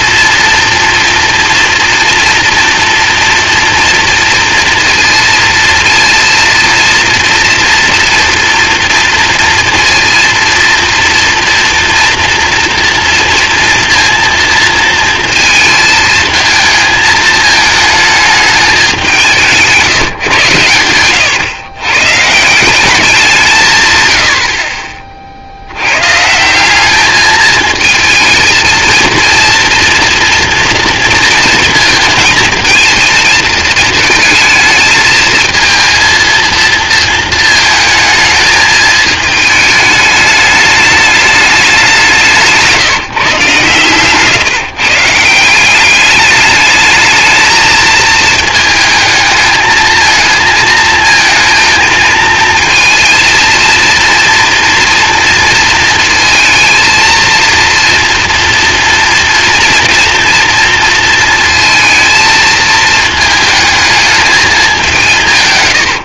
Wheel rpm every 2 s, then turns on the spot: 230, 230, 230, 230, 240, 230, 230, 230, 220, 210, 110, 170, 50, 170, 220, 240, 220, 220, 230, 220, 210, 160, 140, 210, 220, 220, 230, 230, 230, 230, 230, 220, 200.
42-44